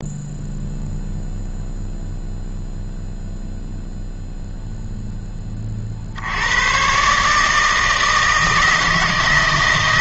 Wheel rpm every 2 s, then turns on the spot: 0, 0, 0, 120, 160.
none